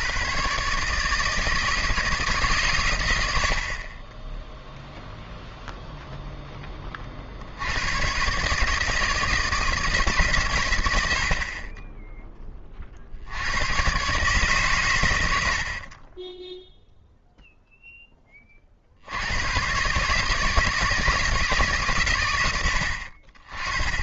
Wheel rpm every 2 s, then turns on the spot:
140, 130, 0, 20, 150, 100, 30, 130, 0, 50, 160, 80.
none